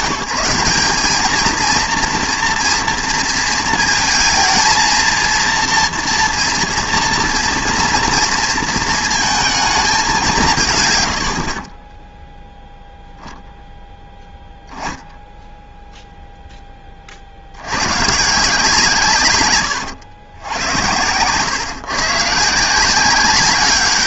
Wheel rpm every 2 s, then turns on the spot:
190, 230, 230, 230, 230, 130, 0, 0, 20, 140, 90, 180.
none